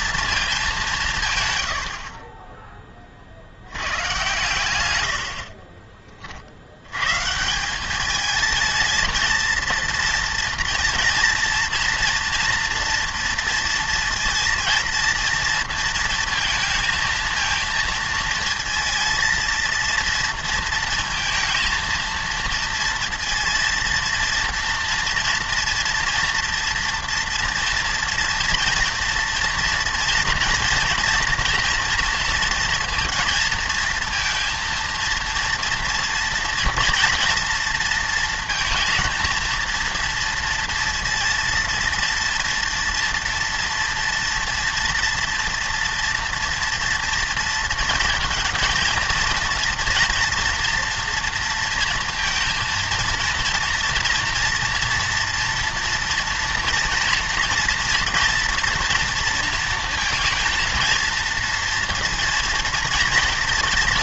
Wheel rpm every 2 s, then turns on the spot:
210, 20, 120, 70, 220, 230, 230, 230, 230, 230, 230, 230, 230, 230, 230, 240, 230, 230, 230, 230, 230, 230, 230, 230, 230, 230, 230, 230, 240, 240, 230, 230.
none